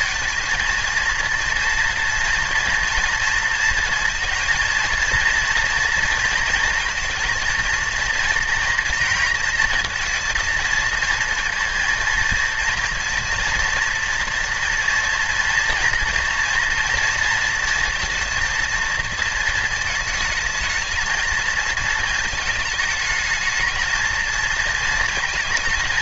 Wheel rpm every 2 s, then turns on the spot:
230, 230, 230, 230, 230, 230, 230, 230, 240, 230, 220, 220, 220.
none